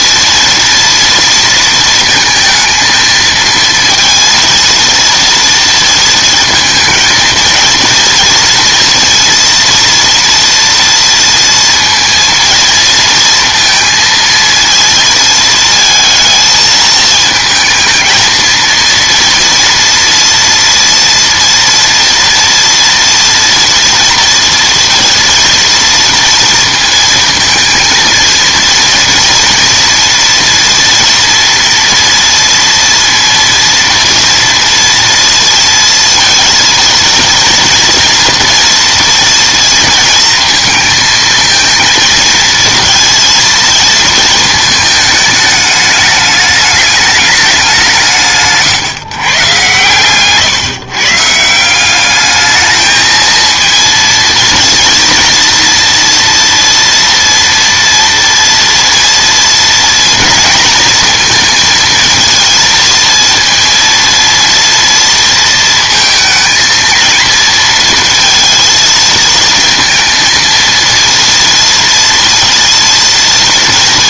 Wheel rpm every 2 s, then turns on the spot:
230, 230, 230, 220, 230, 230, 230, 230, 220, 230, 230, 230, 230, 230, 230, 230, 230, 230, 230, 230, 230, 230, 220, 210, 150, 140, 220, 230, 230, 230, 230, 230, 230, 230, 230, 230, 230.
none